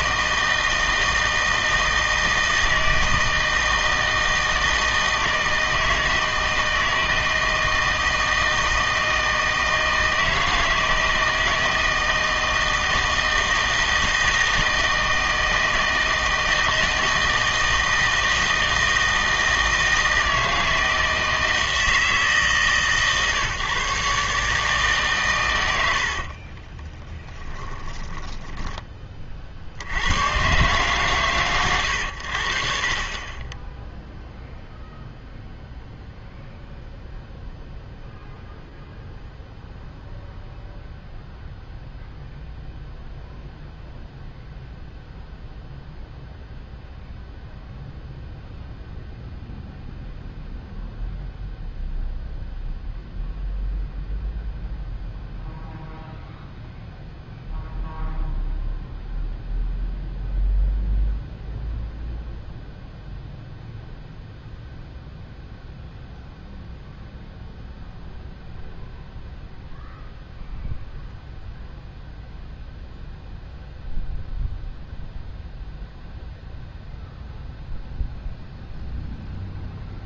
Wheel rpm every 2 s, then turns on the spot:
160, 160, 160, 160, 160, 160, 160, 160, 160, 160, 160, 140, 150, 20, 20, 120, 50, 0, 0, 0, 0, 0, 0, 0, 0, 0, 0, 0, 0, 0, 0, 0, 0, 0, 0, 0, 0, 0, 0, 0.
26-28 32-34